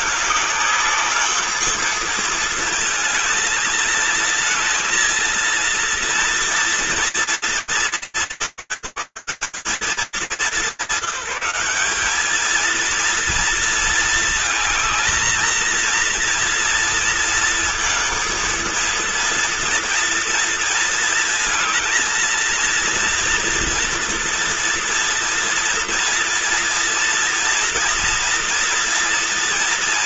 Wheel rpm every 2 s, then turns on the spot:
210, 220, 230, 230, 170, 210, 200, 220, 230, 230, 230, 230, 230, 230, 240.
none